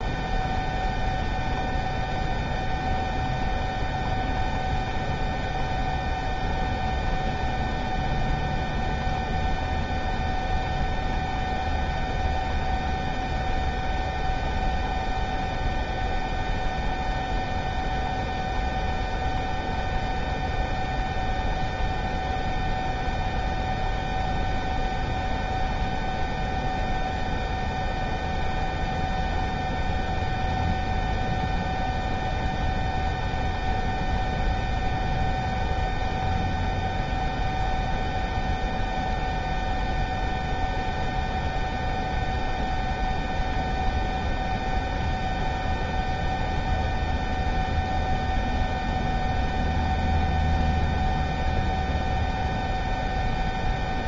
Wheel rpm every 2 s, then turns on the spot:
0, 0, 0, 0, 0, 0, 0, 0, 0, 0, 0, 0, 0, 0, 0, 0, 0, 0, 0, 0, 0, 0, 0, 0, 0, 0, 0.
none